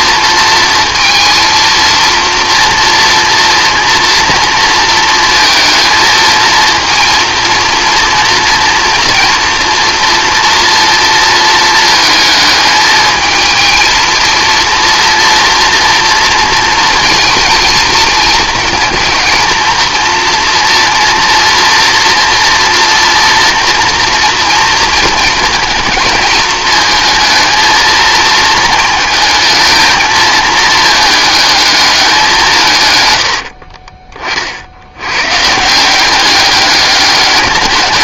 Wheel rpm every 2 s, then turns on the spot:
230, 230, 230, 230, 230, 230, 220, 230, 230, 230, 230, 230, 230, 220, 220, 220, 140, 70, 200.
none